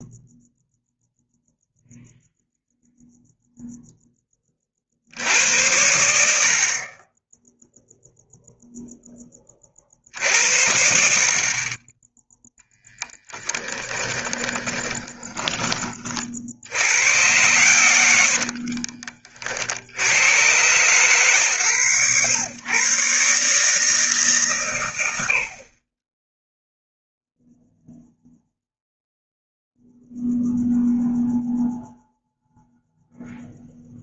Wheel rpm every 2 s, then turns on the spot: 0, 0, 60, 30, 10, 70, 10, 20, 90, 40, 120, 130, 100, 0, 0, 0, 0.
14-16 18-20